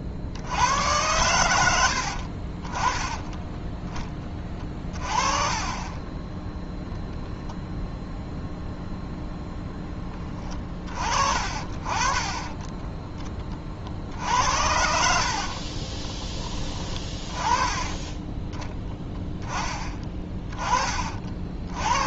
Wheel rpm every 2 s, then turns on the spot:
60, 40, 20, 10, 0, 30, 20, 70, 20, 20, 30.
12-16